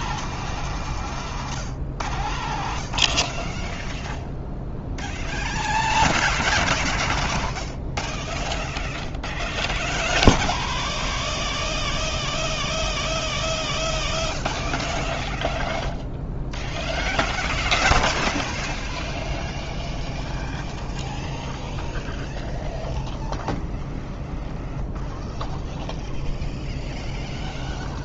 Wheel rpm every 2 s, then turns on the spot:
0, 0, 0, 0, 0, 0, 0, 0, 0, 0, 0, 0, 0, 0.
none